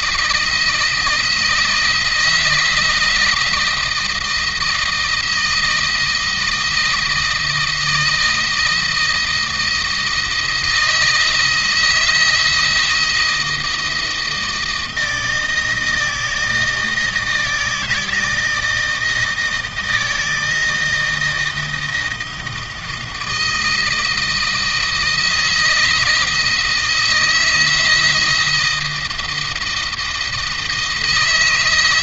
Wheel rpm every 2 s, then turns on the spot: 160, 160, 160, 160, 160, 160, 160, 160, 160, 160, 160, 160, 160, 160, 160, 160.
none